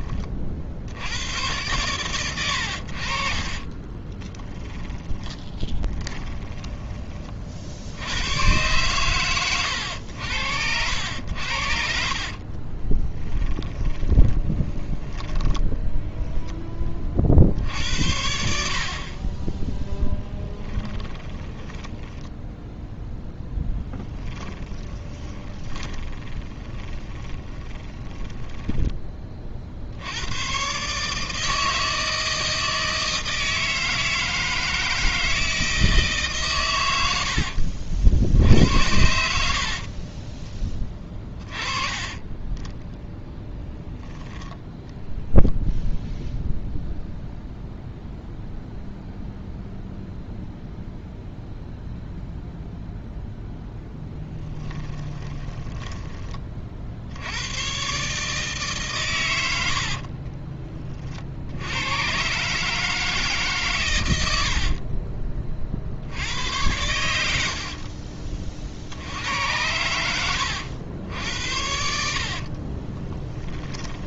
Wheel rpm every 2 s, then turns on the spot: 60, 90, 10, 20, 120, 80, 30, 20, 20, 50, 20, 10, 20, 20, 10, 130, 160, 160, 120, 80, 20, 10, 0, 0, 0, 0, 0, 20, 40, 140, 30, 140, 60, 100, 50, 90, 40.
4-8 12-16 20-30 54-56 64-66 72-74